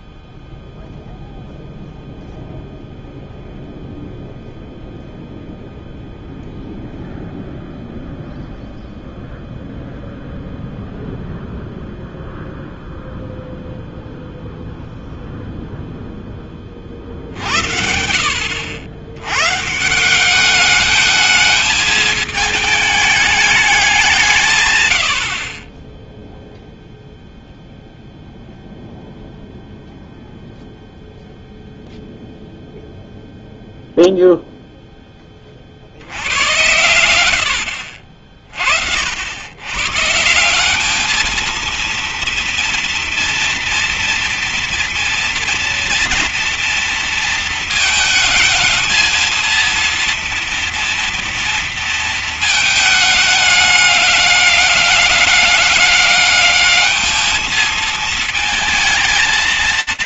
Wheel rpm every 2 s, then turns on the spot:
0, 0, 0, 0, 0, 0, 0, 0, 20, 70, 200, 220, 150, 0, 0, 0, 0, 0, 100, 40, 180, 230, 240, 230, 220, 230, 220, 200, 210, 230.
none